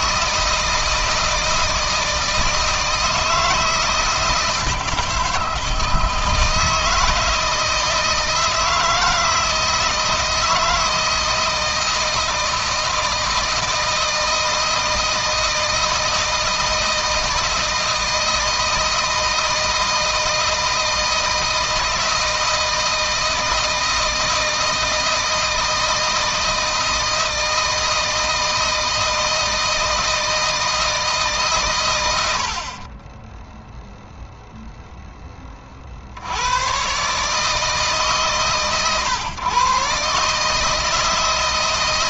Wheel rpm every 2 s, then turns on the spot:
160, 160, 160, 160, 170, 160, 160, 160, 160, 160, 160, 160, 160, 160, 160, 150, 20, 10, 120, 130, 160.
32-34